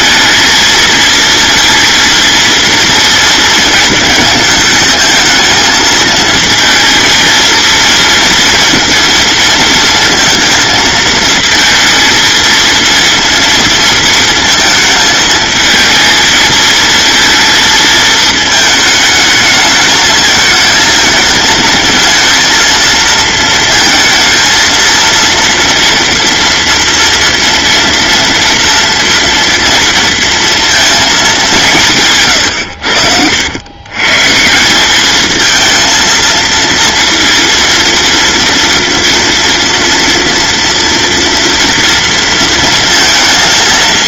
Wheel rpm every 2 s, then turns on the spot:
220, 230, 220, 230, 230, 220, 230, 220, 220, 220, 220, 230, 230, 230, 230, 230, 110, 180, 230, 230, 230, 230.
32-34